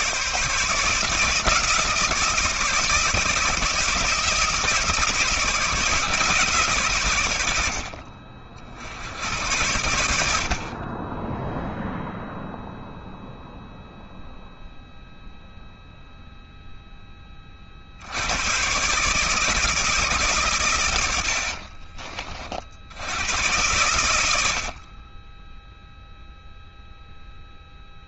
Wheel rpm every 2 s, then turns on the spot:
160, 160, 160, 120, 80, 30, 0, 0, 20, 140, 90, 80, 40, 0.
20-22